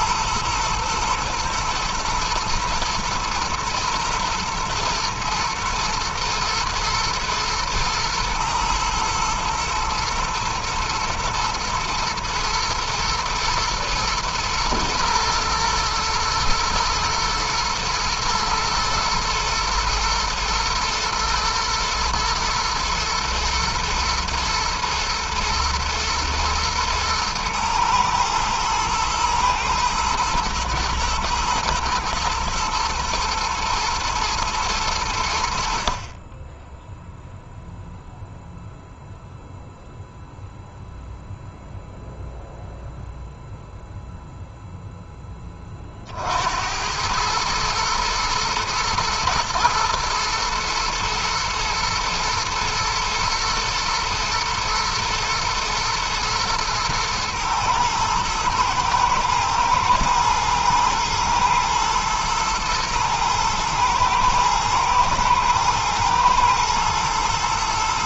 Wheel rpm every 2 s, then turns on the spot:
120, 110, 110, 110, 110, 110, 110, 110, 110, 110, 110, 110, 110, 110, 110, 110, 120, 100, 0, 0, 0, 0, 10, 90, 110, 120, 120, 120, 120, 110, 110, 120, 110, 110.
none